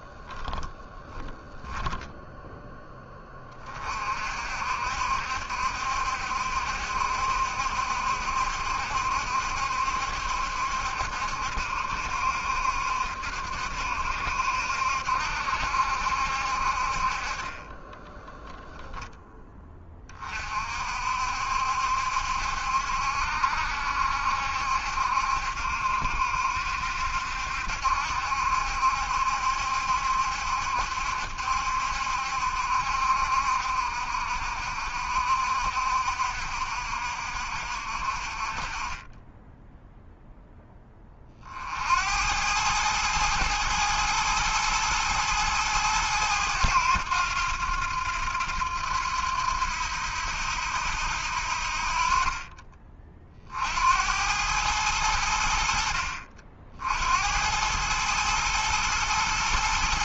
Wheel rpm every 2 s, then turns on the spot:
0, 40, 60, 60, 70, 70, 70, 70, 20, 20, 70, 70, 70, 70, 70, 70, 60, 60, 60, 10, 50, 110, 110, 90, 90, 80, 40, 90, 80, 110.
16-18 38-40